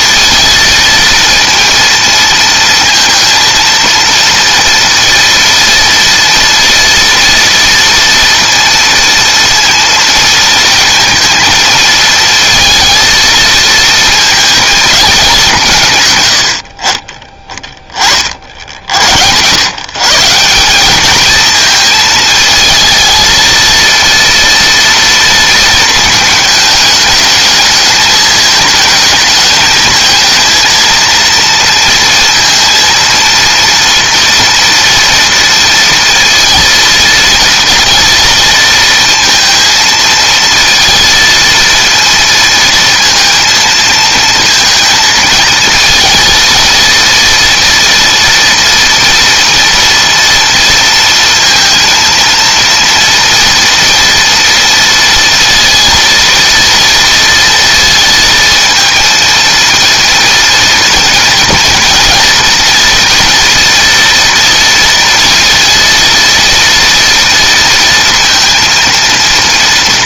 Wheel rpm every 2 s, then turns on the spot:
230, 230, 230, 230, 230, 230, 230, 230, 120, 50, 160, 220, 230, 220, 220, 220, 230, 230, 230, 230, 220, 230, 220, 230, 230, 230, 230, 230, 230, 230, 230, 230, 230, 230, 230.
none